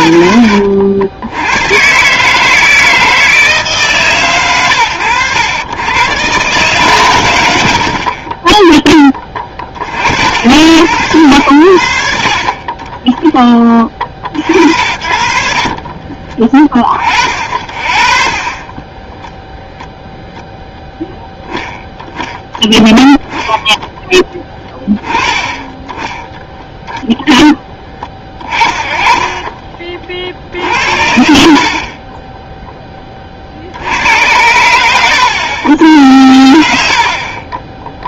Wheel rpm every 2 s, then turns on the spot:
100, 160, 100, 140, 10, 80, 20, 50, 40, 20, 0, 10, 20, 0, 30, 70, 20, 90, 70.
18-20 28-30